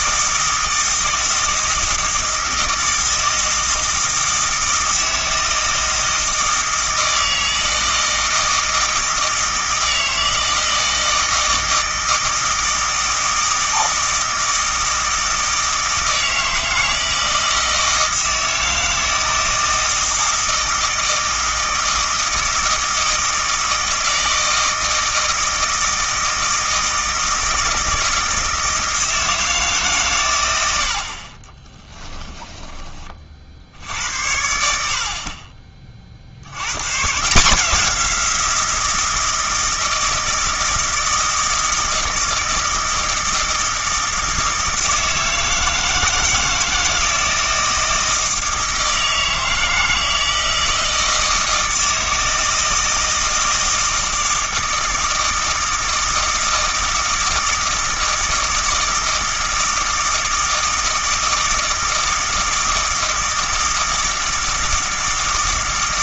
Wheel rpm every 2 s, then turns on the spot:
160, 160, 160, 160, 160, 160, 160, 160, 160, 160, 160, 160, 160, 160, 160, 90, 20, 60, 110, 170, 160, 160, 160, 160, 160, 160, 160, 160, 160, 160, 160, 160, 160.
none